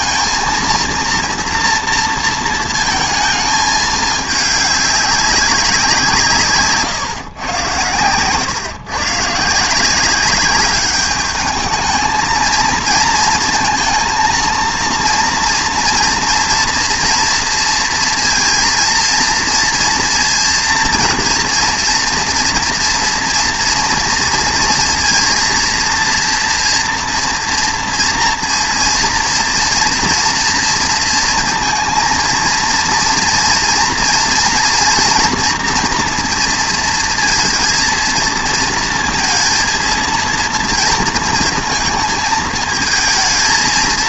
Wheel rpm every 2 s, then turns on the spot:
230, 230, 200, 140, 140, 210, 220, 230, 230, 230, 230, 230, 230, 230, 230, 230, 230, 230, 230, 230, 230, 220.
none